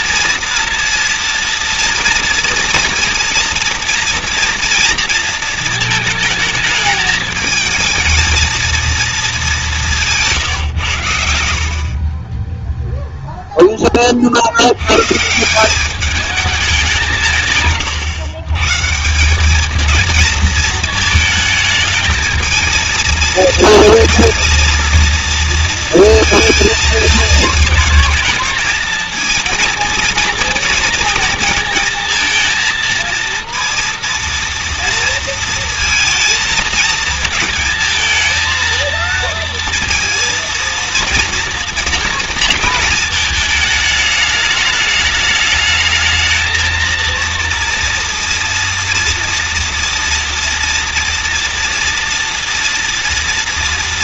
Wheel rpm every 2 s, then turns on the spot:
230, 230, 230, 220, 230, 110, 0, 100, 190, 150, 220, 230, 230, 220, 220, 230, 230, 230, 230, 230, 230, 220, 210, 230, 230, 230, 230.
none